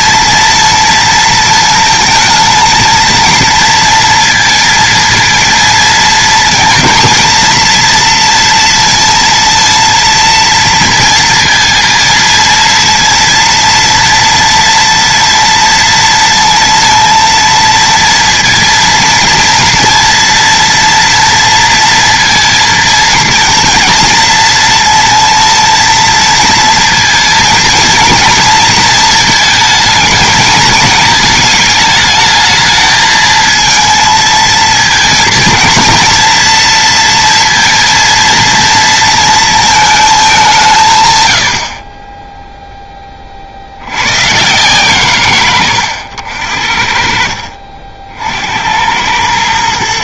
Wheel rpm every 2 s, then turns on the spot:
230, 230, 230, 230, 230, 230, 230, 230, 230, 230, 230, 220, 230, 230, 220, 220, 220, 230, 230, 230, 150, 10, 150, 60, 80.
none